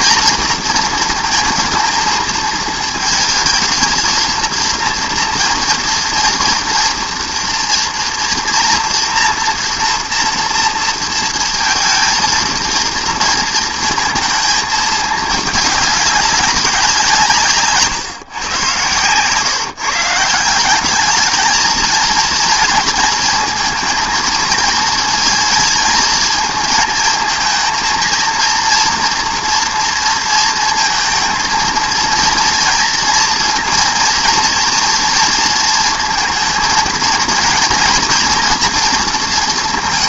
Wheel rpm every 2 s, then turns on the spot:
220, 230, 220, 230, 230, 230, 230, 230, 210, 150, 140, 220, 230, 220, 220, 230, 230, 230, 230, 230.
none